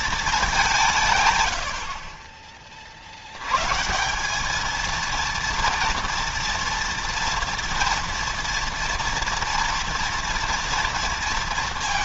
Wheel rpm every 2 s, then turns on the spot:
180, 30, 220, 230, 230, 230.
none